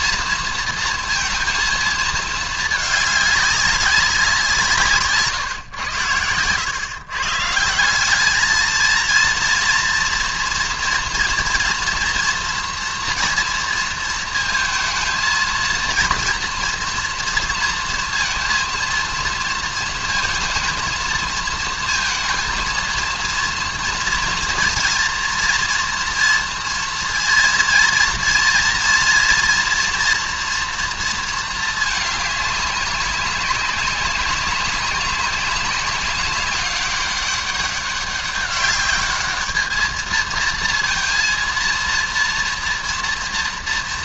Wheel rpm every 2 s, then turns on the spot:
230, 210, 160, 120, 220, 230, 230, 230, 230, 230, 220, 230, 240, 230, 230, 230, 200, 200, 200, 200, 230, 230.
none